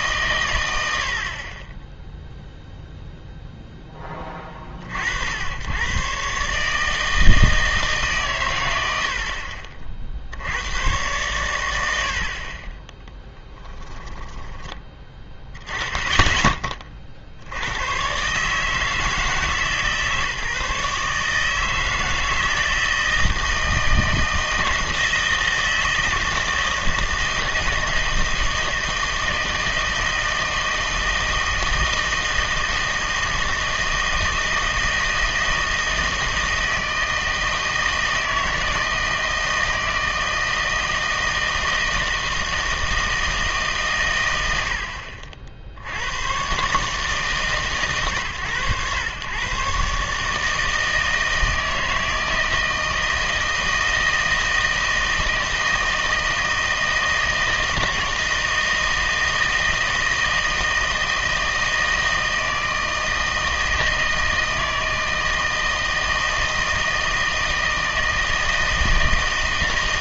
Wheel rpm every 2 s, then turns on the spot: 90, 0, 40, 150, 90, 100, 30, 20, 40, 150, 150, 160, 160, 160, 160, 160, 160, 160, 160, 160, 160, 160, 80, 150, 110, 160, 160, 160, 160, 160, 160, 160, 160, 160, 160.
none